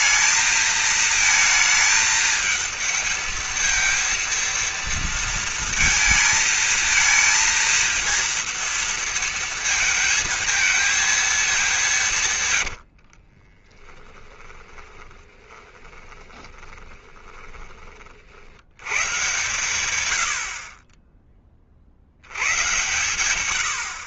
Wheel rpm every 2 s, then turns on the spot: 220, 220, 230, 230, 230, 220, 100, 20, 20, 90, 40, 110.
12-18